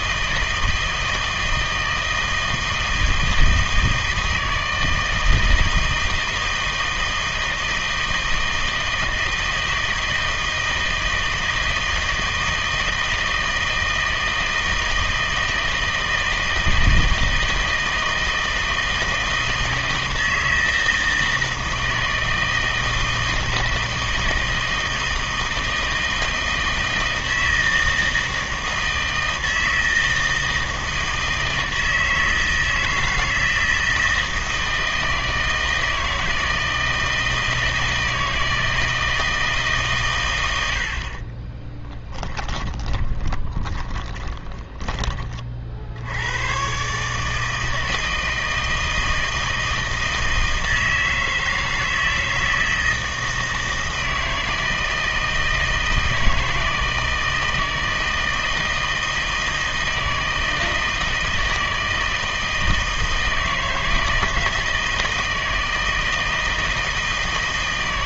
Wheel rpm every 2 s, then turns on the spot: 160, 160, 160, 160, 160, 160, 160, 160, 160, 160, 160, 160, 160, 160, 160, 160, 160, 160, 160, 160, 80, 10, 20, 130, 160, 160, 160, 160, 160, 160, 160, 160, 160, 160.
42-46